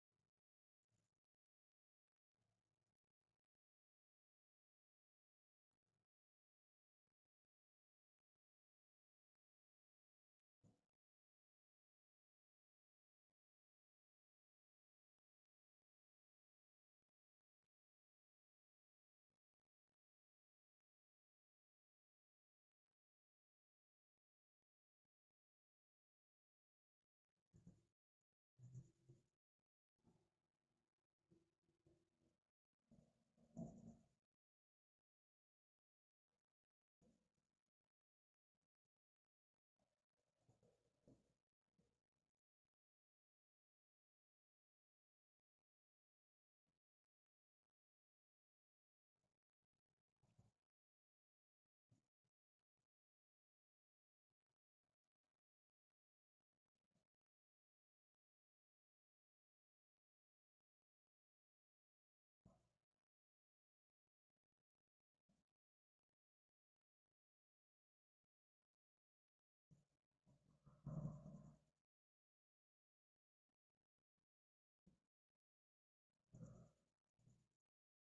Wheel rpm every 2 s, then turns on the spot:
0, 0, 0, 0, 0, 0, 0, 0, 0, 0, 0, 0, 0, 0, 0, 0, 0, 0, 0, 0, 0, 0, 0, 0, 0, 0, 0, 0, 0, 0, 0, 0, 0, 0, 0, 0, 0, 0, 0.
none